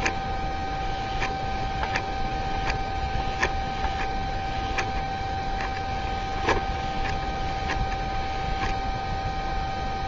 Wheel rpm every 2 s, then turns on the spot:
0, 0, 0, 10, 0.
none